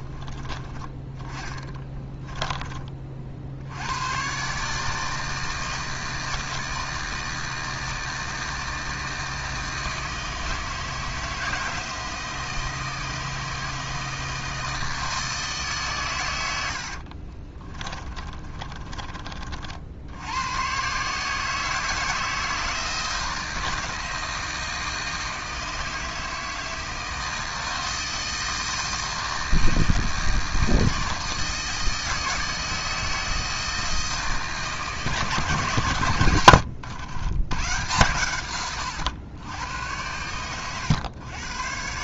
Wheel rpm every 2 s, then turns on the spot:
20, 30, 150, 160, 160, 160, 160, 160, 60, 30, 140, 160, 160, 160, 160, 160, 160, 140, 100, 100, 110.
0-2 16-20